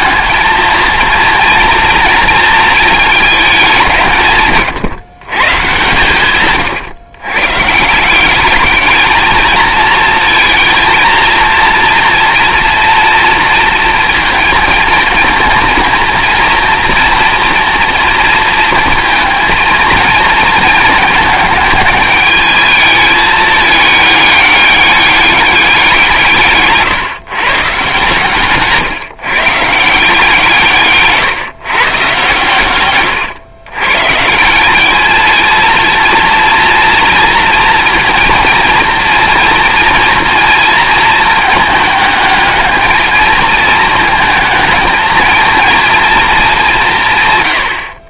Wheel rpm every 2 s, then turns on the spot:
230, 180, 130, 170, 220, 240, 230, 230, 230, 230, 210, 210, 180, 140, 160, 130, 130, 230, 230, 230, 220, 220, 230, 50.
none